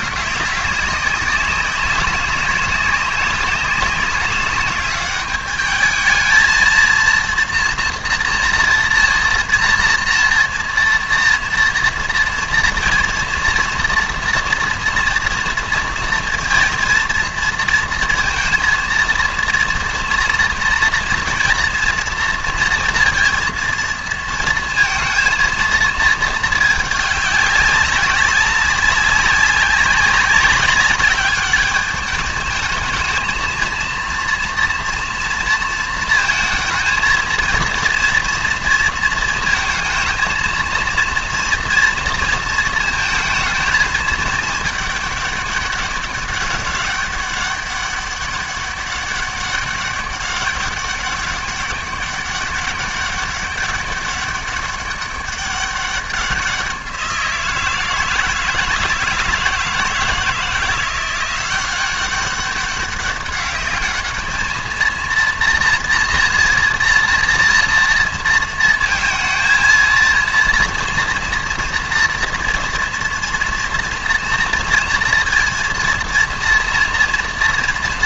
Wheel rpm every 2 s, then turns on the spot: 200, 190, 200, 220, 230, 230, 230, 240, 230, 230, 230, 230, 230, 210, 190, 200, 220, 230, 220, 230, 230, 220, 210, 200, 200, 200, 200, 200, 180, 160, 170, 200, 220, 230, 230, 230, 230, 230, 230.
none